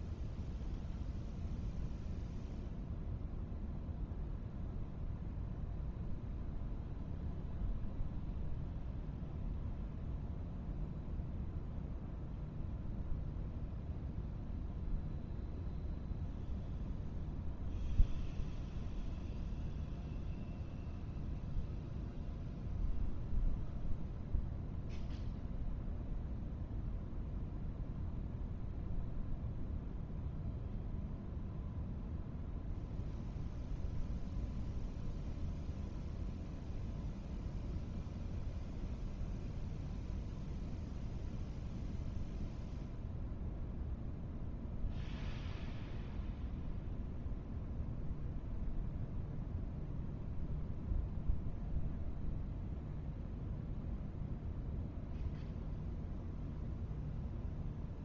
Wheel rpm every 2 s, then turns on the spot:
0, 0, 0, 0, 0, 0, 0, 0, 0, 0, 0, 0, 0, 0, 0, 0, 0, 0, 0, 0, 0, 0, 0, 0, 0, 0, 0, 0, 0.
none